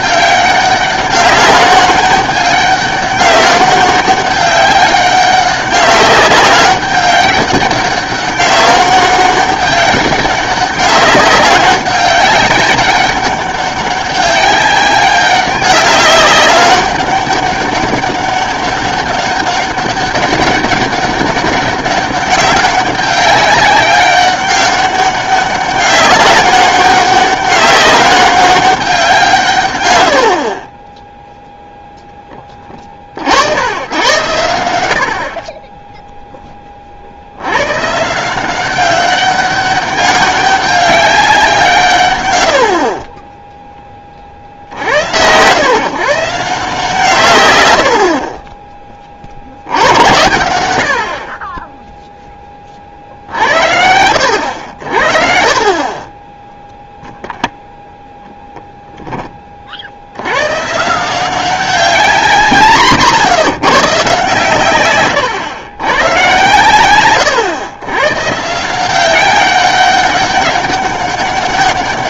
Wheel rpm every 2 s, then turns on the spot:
190, 200, 200, 200, 200, 200, 200, 200, 190, 200, 200, 200, 200, 200, 190, 40, 30, 90, 30, 190, 200, 80, 70, 160, 20, 90, 40, 70, 0, 0, 130, 150, 120, 120, 160, 200.
none